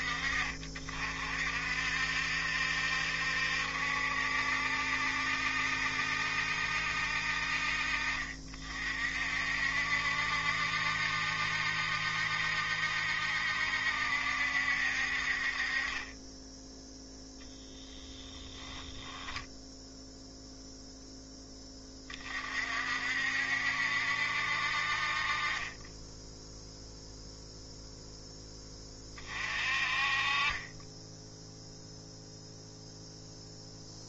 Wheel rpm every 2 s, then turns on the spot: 40, 70, 70, 60, 50, 70, 70, 60, 0, 10, 0, 50, 50, 0, 20, 20, 0.
none